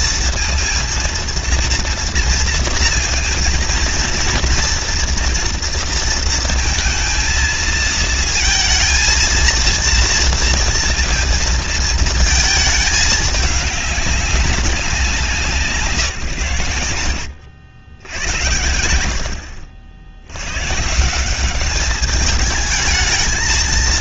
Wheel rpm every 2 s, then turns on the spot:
230, 230, 230, 220, 230, 230, 220, 200, 120, 90, 100, 210.
none